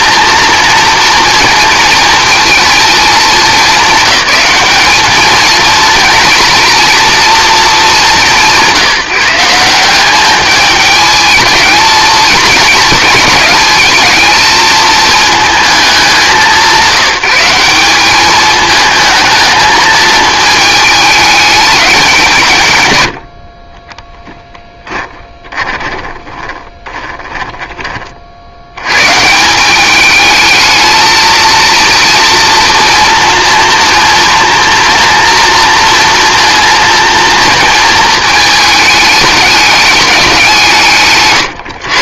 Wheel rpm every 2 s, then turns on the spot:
230, 220, 210, 230, 160, 210, 230, 220, 170, 220, 210, 120, 20, 20, 100, 220, 230, 240, 230, 210, 150.
24-28